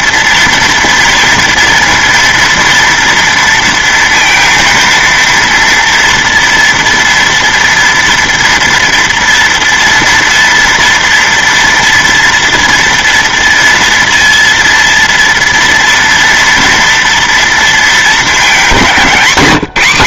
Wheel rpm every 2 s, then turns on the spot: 230, 230, 230, 230, 240, 230, 230, 230, 240, 200.
none